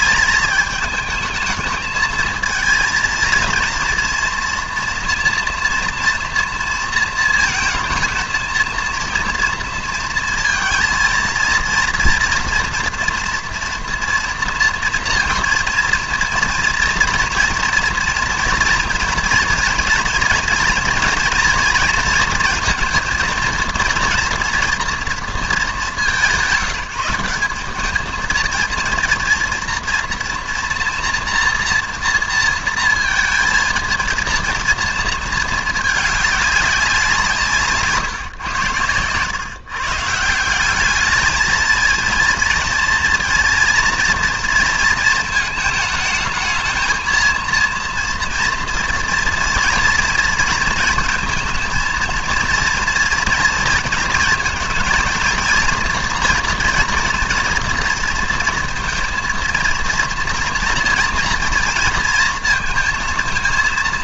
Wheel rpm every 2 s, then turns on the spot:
220, 230, 230, 230, 230, 230, 230, 230, 230, 230, 230, 230, 240, 190, 230, 230, 230, 230, 200, 110, 190, 230, 230, 220, 240, 220, 230, 220, 230, 230, 230, 230.
none